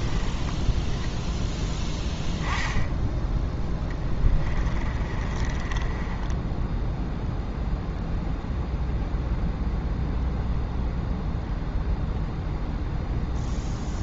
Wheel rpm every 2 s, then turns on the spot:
10, 10, 30, 0, 0, 0, 0.
4-6